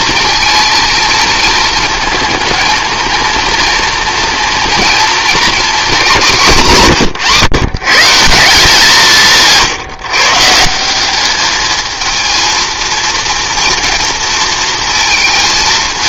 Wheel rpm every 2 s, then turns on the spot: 220, 220, 230, 180, 180, 180, 230, 230.
none